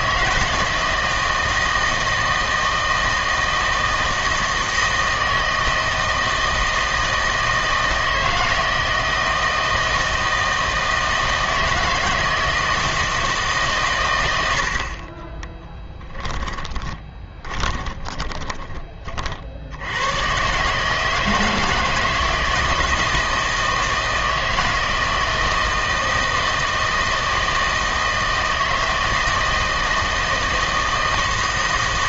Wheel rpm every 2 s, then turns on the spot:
160, 160, 160, 160, 160, 160, 160, 80, 10, 20, 140, 160, 160, 160, 160, 160.
16-18